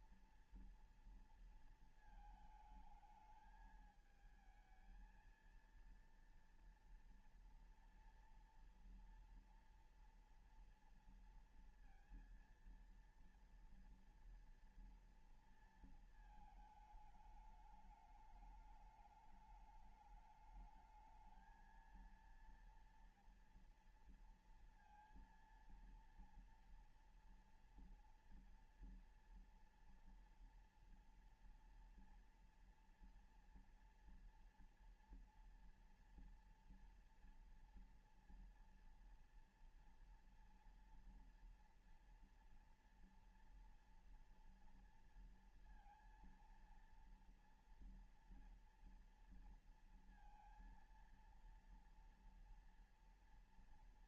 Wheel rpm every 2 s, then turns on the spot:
230, 220, 220, 230, 230, 230, 230, 230, 220, 210, 220, 230, 230, 230, 230, 240, 230, 230, 230, 230, 230, 230, 230, 230, 230, 230, 230.
none